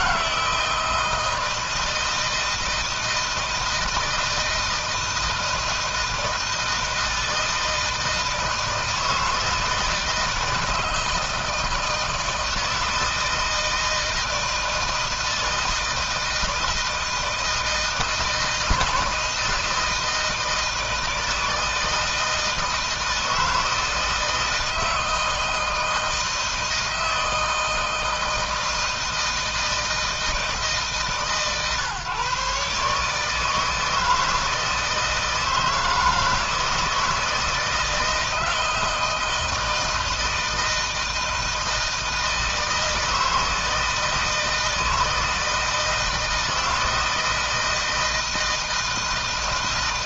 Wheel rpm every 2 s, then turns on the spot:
160, 160, 160, 160, 160, 160, 160, 160, 160, 160, 160, 160, 160, 160, 160, 160, 140, 160, 170, 170, 160, 160, 160, 160, 160.
none